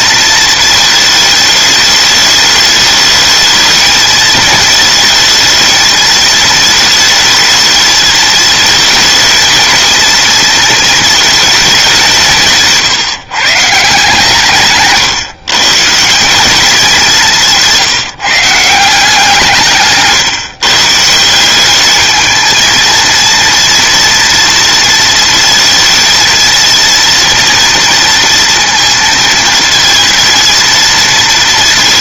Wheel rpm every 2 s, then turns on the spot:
220, 210, 220, 220, 220, 230, 200, 150, 160, 170, 150, 210, 230, 230, 230, 230.
none